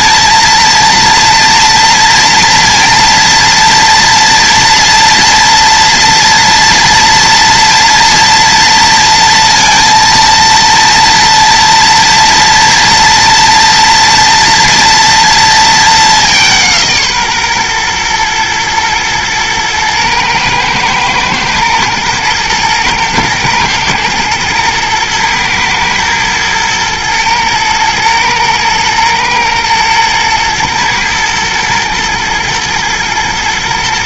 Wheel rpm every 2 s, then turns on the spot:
230, 230, 230, 230, 230, 230, 240, 230, 170, 110, 120, 110, 110, 120, 110, 110, 110.
none